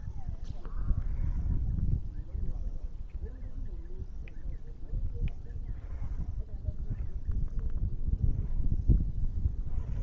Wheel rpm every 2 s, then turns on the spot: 0, 0, 0, 0, 0.
none